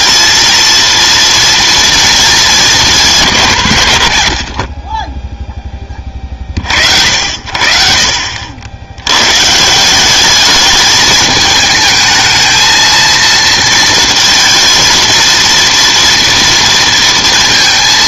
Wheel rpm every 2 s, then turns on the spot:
230, 210, 50, 50, 70, 210, 220, 230, 230.
none